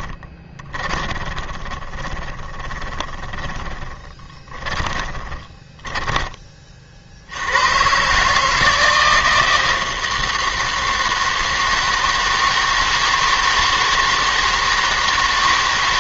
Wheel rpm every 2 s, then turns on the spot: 20, 20, 20, 40, 160, 160, 160, 160.
0-6